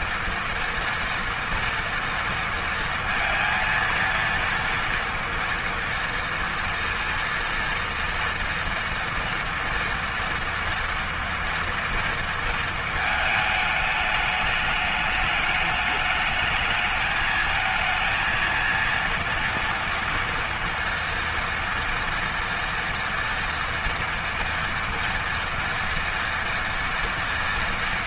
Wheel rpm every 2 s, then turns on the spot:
230, 230, 230, 230, 230, 230, 220, 210, 220, 230, 240, 230, 230, 230.
none